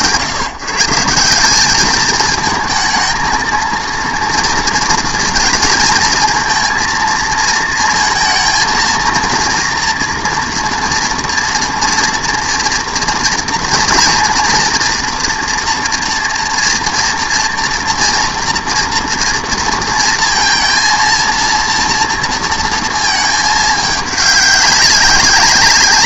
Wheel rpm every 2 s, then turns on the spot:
140, 220, 230, 230, 230, 230, 230, 230, 230, 240, 230, 230, 200.
none